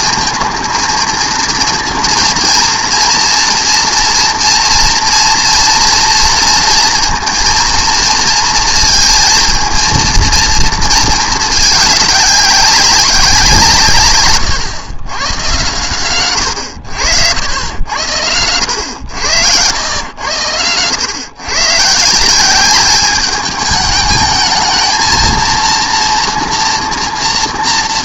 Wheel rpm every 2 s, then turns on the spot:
230, 230, 230, 230, 230, 210, 160, 110, 90, 100, 130, 210, 230, 240.
none